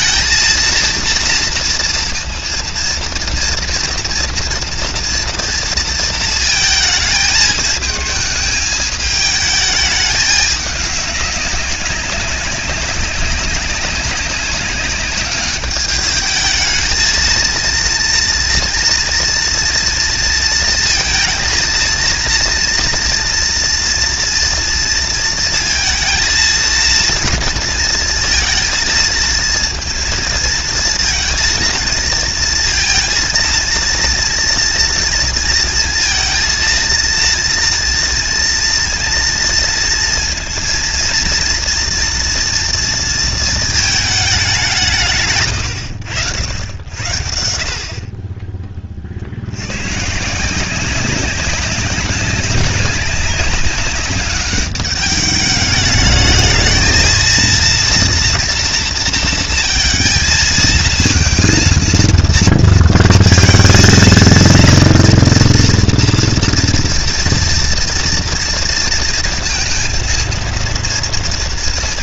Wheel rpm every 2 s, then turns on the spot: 230, 230, 230, 220, 220, 200, 200, 200, 220, 230, 230, 230, 230, 230, 230, 230, 230, 230, 230, 230, 230, 230, 150, 80, 40, 190, 200, 200, 220, 230, 220, 230, 230, 230, 230, 230.
none